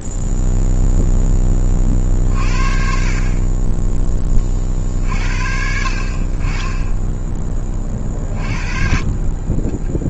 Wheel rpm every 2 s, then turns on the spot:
0, 40, 50, 20, 40.
none